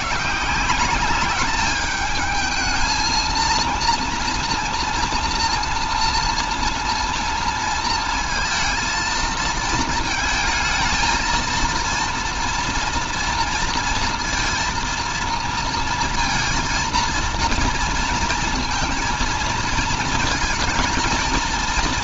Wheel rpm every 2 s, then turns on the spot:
190, 220, 240, 230, 220, 230, 240, 230, 230, 230, 220.
none